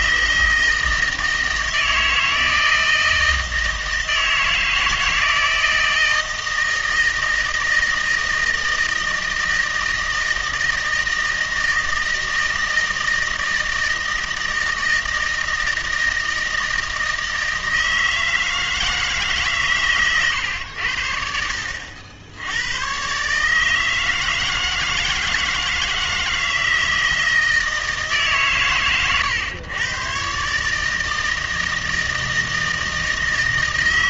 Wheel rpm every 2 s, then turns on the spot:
160, 160, 160, 160, 160, 160, 160, 160, 160, 160, 80, 110, 160, 160, 120, 150, 160.
none